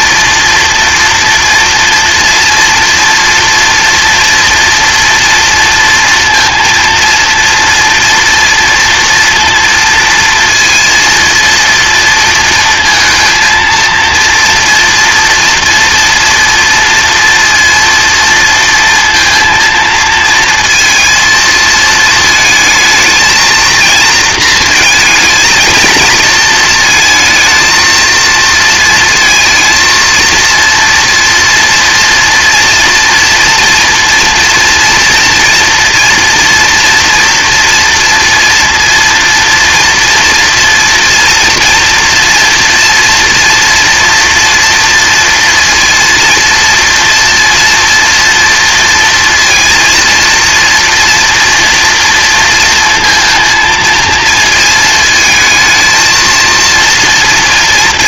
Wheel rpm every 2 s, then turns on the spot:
230, 230, 230, 230, 230, 230, 230, 230, 230, 230, 230, 220, 230, 230, 230, 230, 230, 230, 240, 230, 230, 230, 230, 230, 230, 230, 230, 230, 230.
none